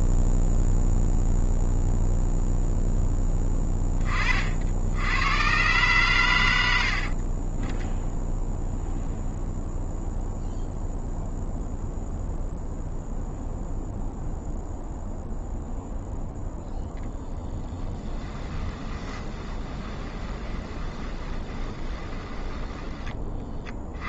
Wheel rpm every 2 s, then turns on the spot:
0, 0, 20, 120, 20, 0, 0, 0, 0, 20, 20, 20.
18-22